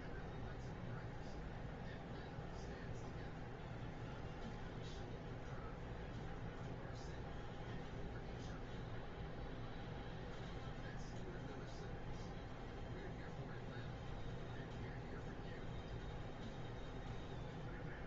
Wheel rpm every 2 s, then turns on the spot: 0, 0, 0, 0, 0, 0, 0, 0, 0.
none